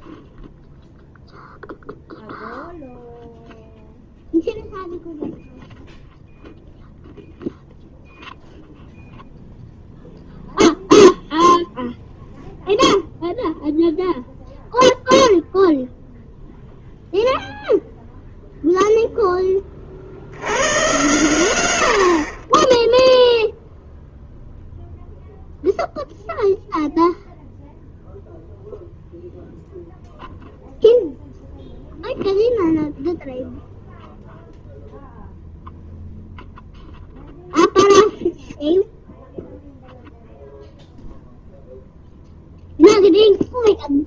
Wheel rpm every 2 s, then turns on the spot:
0, 0, 0, 0, 0, 0, 0, 0, 0, 0, 80, 50, 0, 0, 0, 0, 0, 0, 0, 0, 0, 0.
none